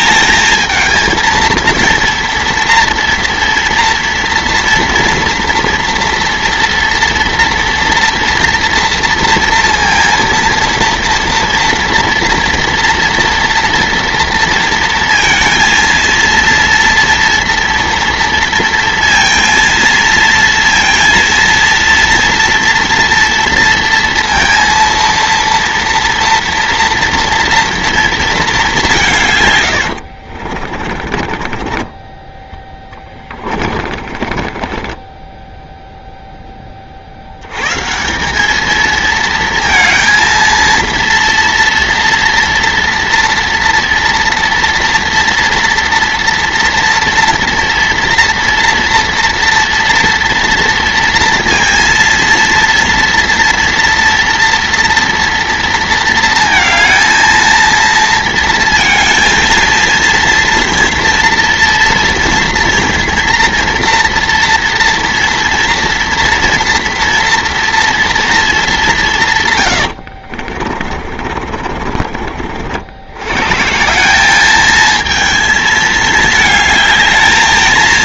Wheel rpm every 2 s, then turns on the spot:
220, 230, 230, 230, 230, 230, 230, 230, 230, 230, 230, 230, 230, 240, 200, 50, 20, 20, 20, 210, 230, 230, 230, 230, 230, 230, 230, 240, 230, 230, 230, 230, 230, 230, 220, 60, 70, 210, 220.
30-36 70-72